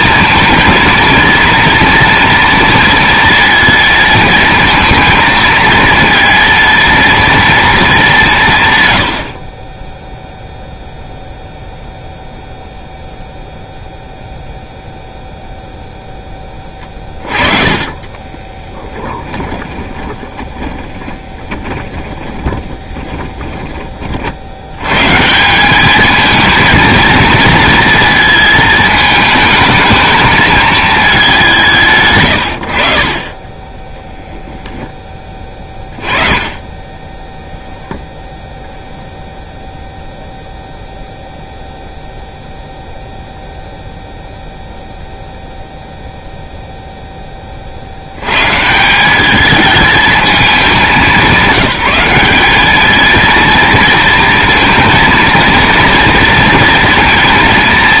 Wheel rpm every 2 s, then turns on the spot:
230, 230, 230, 230, 120, 0, 0, 0, 20, 20, 20, 10, 110, 220, 220, 220, 60, 10, 10, 0, 0, 0, 0, 0, 170, 210, 210, 230, 230.
16-24